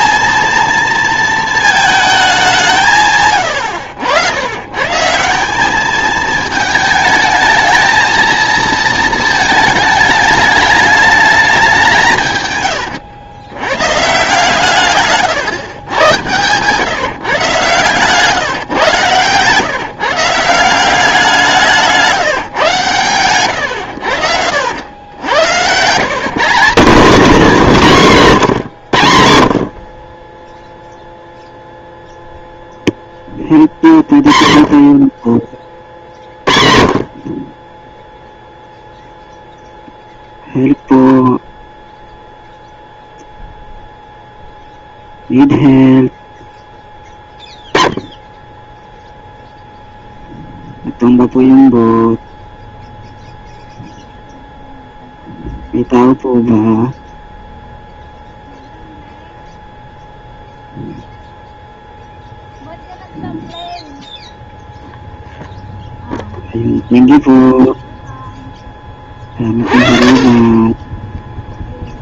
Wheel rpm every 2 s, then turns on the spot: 230, 160, 120, 220, 230, 210, 120, 150, 130, 140, 180, 130, 80, 210, 140, 0, 0, 40, 40, 0, 0, 0, 0, 10, 10, 0, 0, 0, 0, 0, 0, 0, 0, 0, 10, 10.
70-72